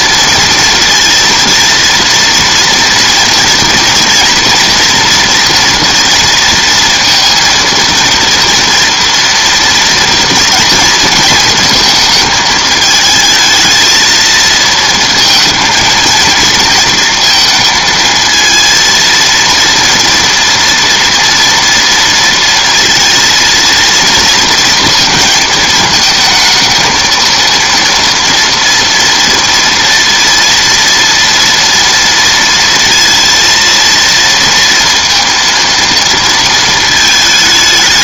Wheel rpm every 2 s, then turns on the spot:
230, 230, 230, 230, 230, 230, 220, 230, 230, 230, 230, 230, 230, 220, 230, 230, 230, 230, 220.
none